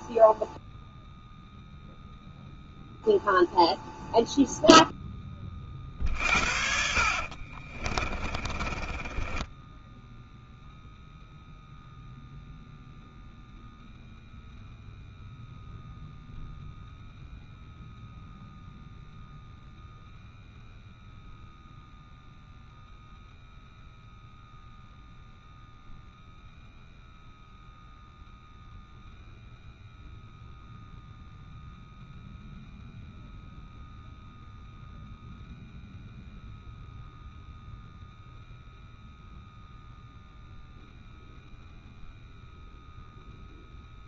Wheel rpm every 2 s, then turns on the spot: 0, 0, 0, 50, 20, 0, 0, 0, 0, 0, 0, 0, 0, 0, 0, 0, 0, 0, 0, 0, 0, 0.
6-10